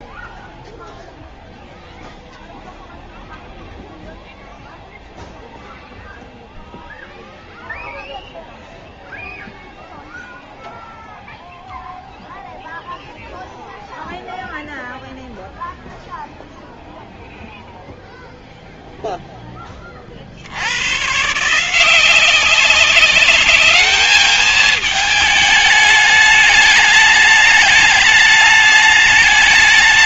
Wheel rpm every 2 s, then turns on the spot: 0, 0, 0, 0, 0, 0, 0, 0, 0, 0, 110, 200, 210, 220, 210.
none